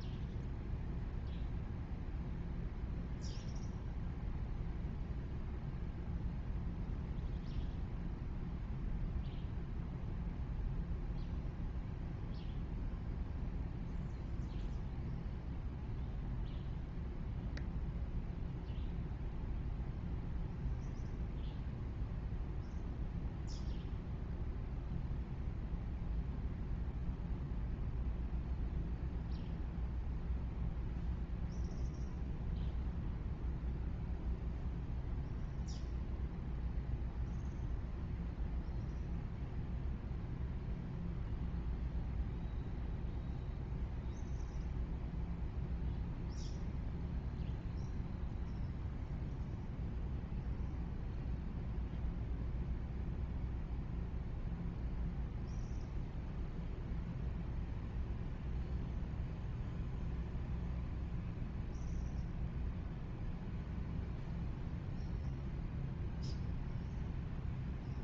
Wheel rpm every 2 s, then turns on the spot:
0, 0, 0, 0, 0, 0, 0, 0, 0, 0, 0, 0, 0, 0, 0, 0, 0, 0, 0, 0, 0, 0, 0, 0, 0, 0, 0, 0, 0, 0, 0, 0, 0, 0.
none